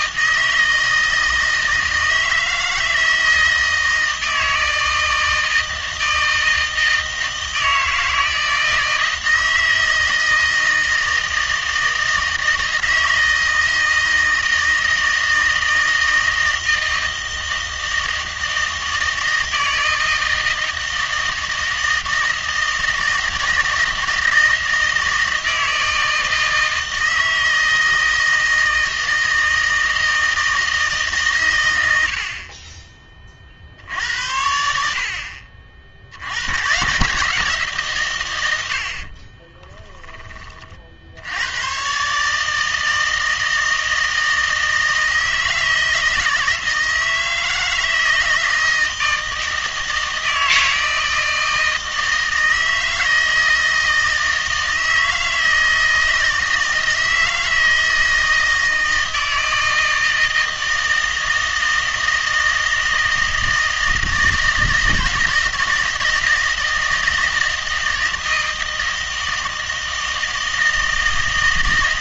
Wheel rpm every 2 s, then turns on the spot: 160, 160, 160, 160, 160, 160, 160, 160, 160, 160, 160, 160, 160, 160, 160, 160, 30, 60, 110, 90, 40, 160, 160, 160, 160, 160, 160, 160, 160, 160, 160, 160, 160, 160, 160, 160.
none